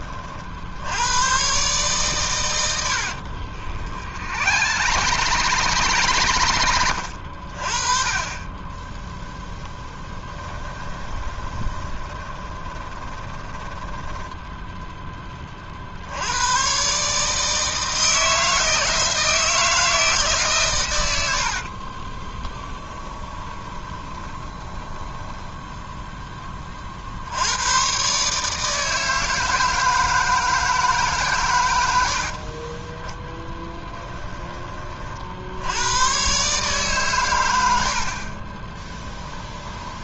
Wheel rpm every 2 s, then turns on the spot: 60, 90, 100, 80, 10, 20, 20, 10, 120, 160, 120, 10, 20, 40, 160, 160, 20, 30, 140, 20.
4-6 10-14 22-26 38-40